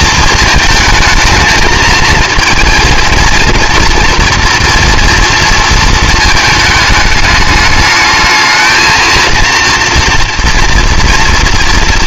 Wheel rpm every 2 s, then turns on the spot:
220, 230, 230, 220, 220, 230.
none